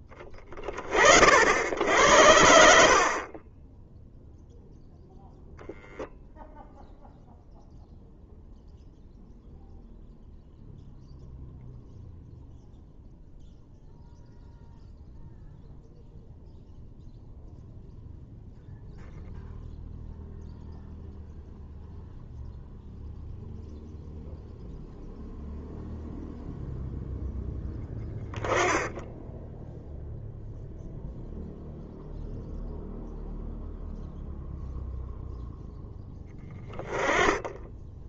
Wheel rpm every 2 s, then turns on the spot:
50, 50, 0, 0, 0, 0, 0, 0, 0, 0, 0, 0, 0, 0, 10, 0, 0, 0, 10.
none